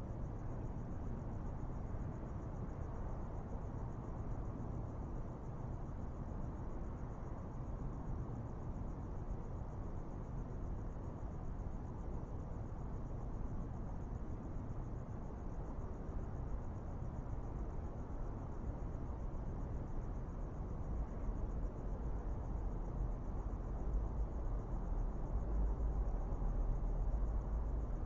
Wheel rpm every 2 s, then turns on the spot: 0, 0, 0, 0, 0, 0, 0, 0, 0, 0, 0, 0, 0, 0.
none